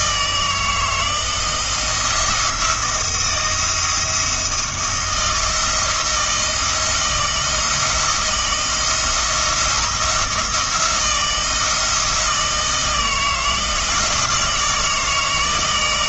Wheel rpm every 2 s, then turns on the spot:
160, 170, 170, 170, 170, 170, 160, 160.
none